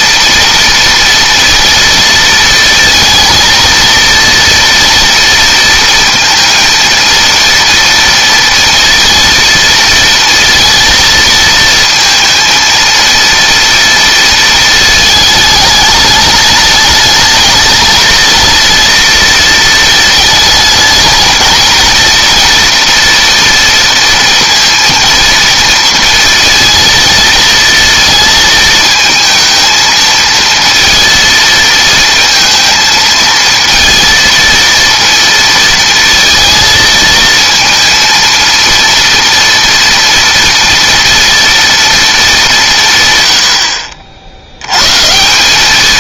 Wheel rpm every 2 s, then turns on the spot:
230, 230, 230, 230, 230, 230, 230, 220, 210, 230, 220, 240, 230, 230, 220, 230, 230, 230, 220, 230, 230, 170, 100.
none